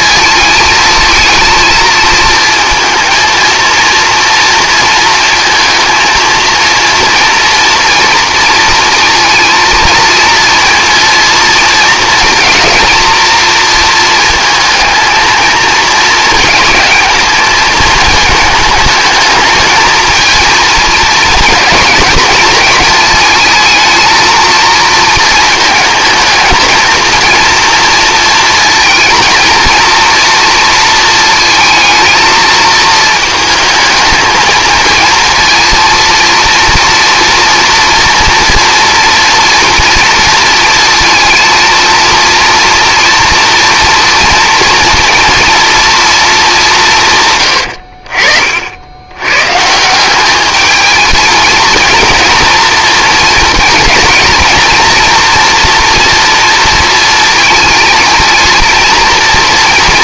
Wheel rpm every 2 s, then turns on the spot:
230, 230, 230, 230, 230, 230, 220, 220, 220, 220, 230, 220, 230, 220, 230, 230, 220, 220, 230, 230, 230, 230, 230, 190, 60, 210, 230, 220, 230, 230.
none